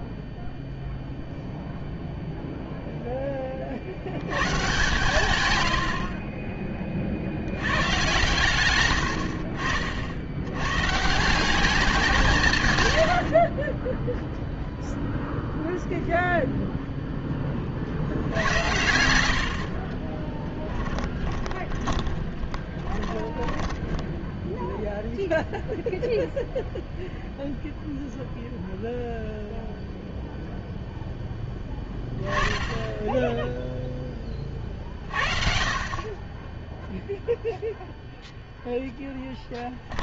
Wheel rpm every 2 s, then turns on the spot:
0, 0, 130, 10, 120, 100, 130, 0, 0, 80, 20, 20, 0, 0, 0, 0, 10, 40, 10, 0.
20-24